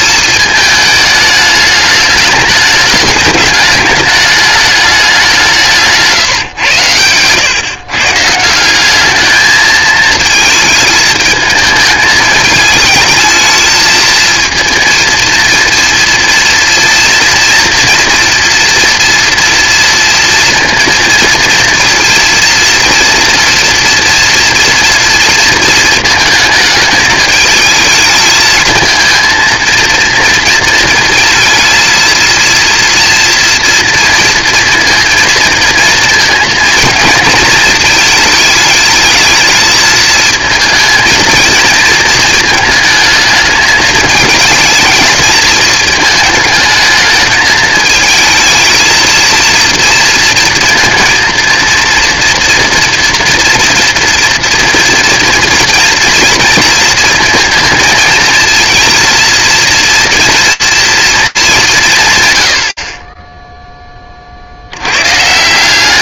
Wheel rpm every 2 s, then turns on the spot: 220, 210, 210, 120, 180, 220, 220, 230, 240, 240, 230, 230, 230, 220, 220, 230, 230, 230, 230, 210, 220, 220, 220, 220, 230, 230, 230, 230, 220, 230, 230, 40, 80.
none